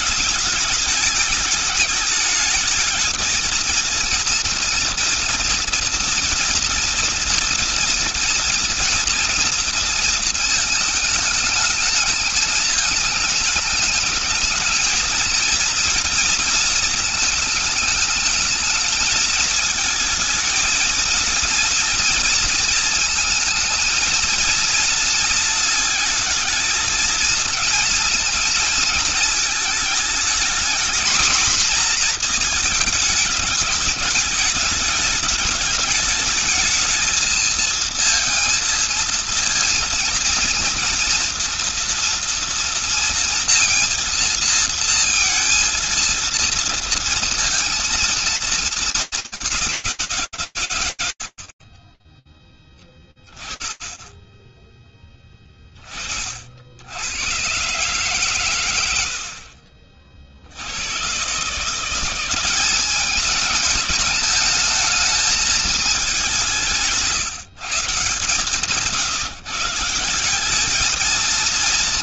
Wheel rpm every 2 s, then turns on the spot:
220, 210, 230, 230, 230, 220, 220, 220, 240, 220, 230, 230, 230, 230, 230, 220, 230, 210, 220, 230, 230, 230, 230, 230, 220, 160, 30, 20, 60, 110, 80, 200, 220, 190, 150, 210.
52-54